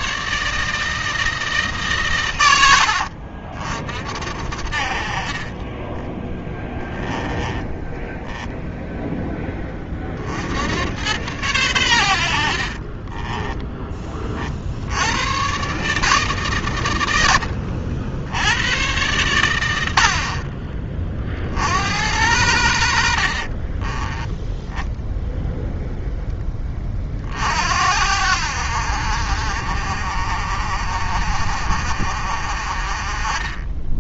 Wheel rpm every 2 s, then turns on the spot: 150, 90, 60, 20, 10, 90, 40, 60, 130, 110, 40, 80, 10, 20, 60, 40, 30.
6-8 12-14 20-22